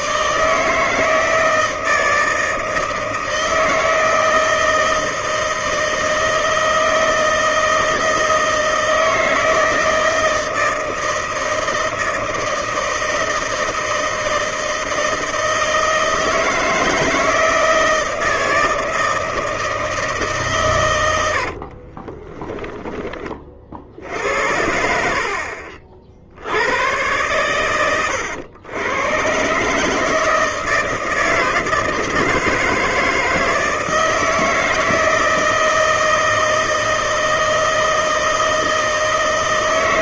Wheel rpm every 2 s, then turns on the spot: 150, 160, 160, 160, 160, 160, 160, 160, 160, 160, 150, 20, 70, 60, 100, 160, 160, 160, 160, 160.
22-24